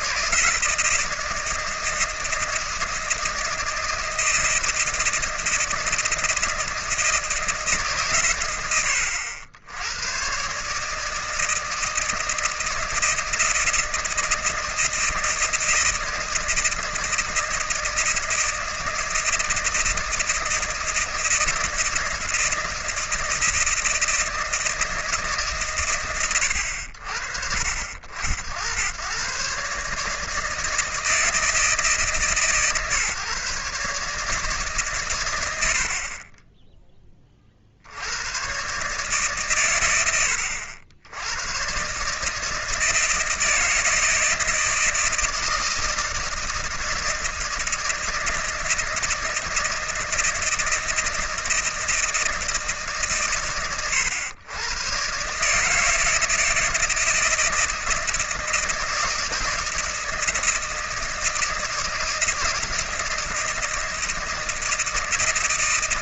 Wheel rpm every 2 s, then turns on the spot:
160, 160, 160, 160, 90, 150, 160, 160, 160, 160, 160, 170, 160, 70, 90, 160, 140, 130, 10, 130, 80, 160, 160, 160, 160, 160, 150, 120, 160, 160, 160, 160, 160.
none